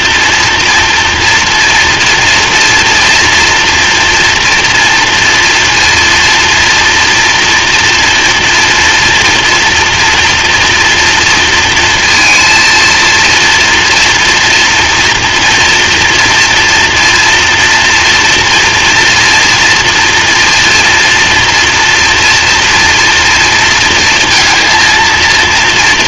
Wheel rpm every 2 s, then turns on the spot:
230, 230, 240, 230, 230, 230, 230, 230, 230, 230, 230, 240, 230.
none